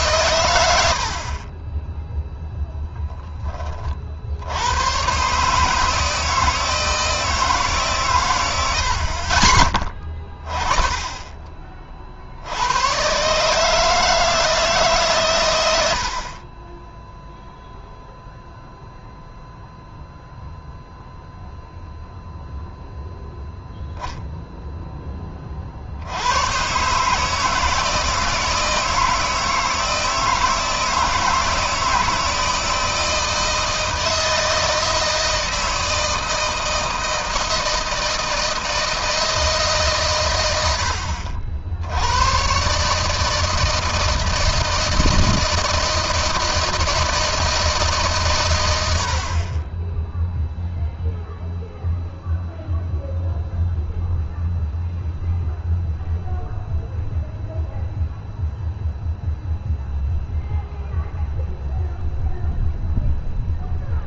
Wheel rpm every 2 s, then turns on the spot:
70, 0, 110, 160, 90, 30, 110, 140, 10, 0, 0, 0, 10, 130, 160, 160, 160, 160, 160, 160, 60, 140, 160, 160, 80, 0, 0, 0, 0, 0, 0, 0.
none